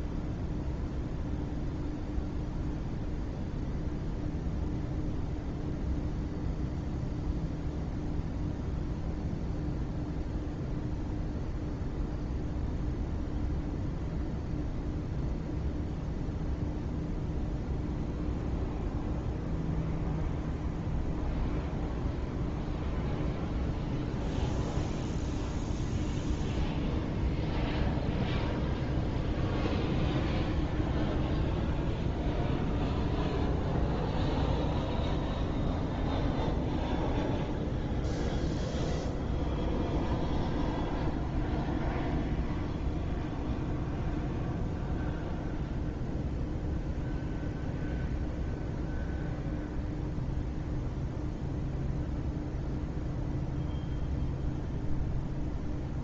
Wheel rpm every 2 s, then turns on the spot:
0, 0, 0, 0, 0, 0, 0, 0, 0, 0, 0, 0, 0, 0, 0, 0, 0, 0, 0, 0, 0, 0, 0, 0, 0, 0, 0, 0.
none